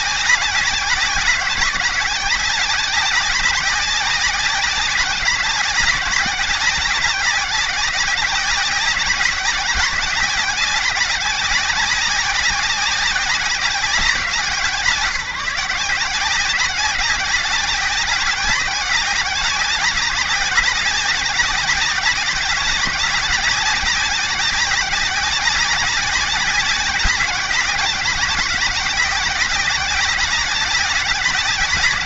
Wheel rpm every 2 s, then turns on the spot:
180, 190, 190, 190, 190, 190, 200, 160, 180, 190, 190, 180, 190, 190, 180, 190.
none